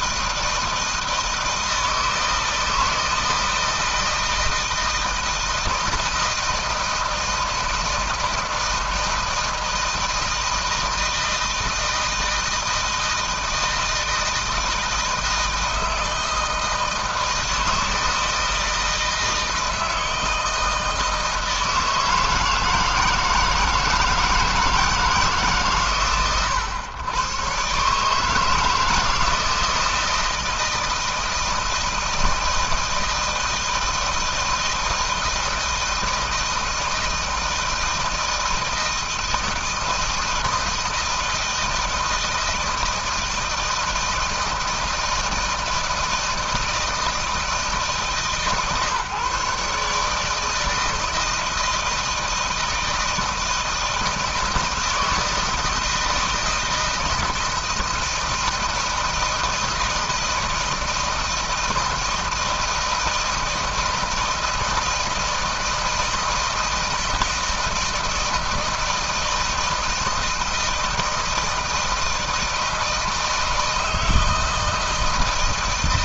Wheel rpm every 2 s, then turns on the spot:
160, 160, 160, 160, 160, 160, 160, 160, 160, 160, 160, 160, 160, 110, 160, 160, 160, 160, 160, 160, 160, 160, 160, 160, 150, 160, 160, 160, 160, 160, 160, 160, 160, 160, 160, 160, 160, 160.
none